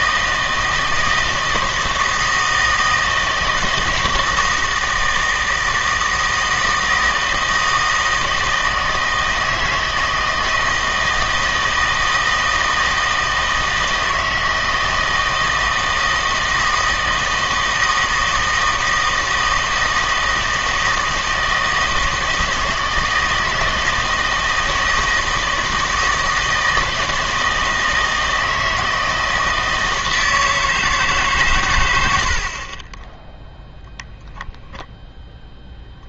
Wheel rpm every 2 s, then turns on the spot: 160, 160, 160, 160, 160, 160, 160, 160, 160, 160, 160, 160, 160, 160, 160, 160, 30, 0.
none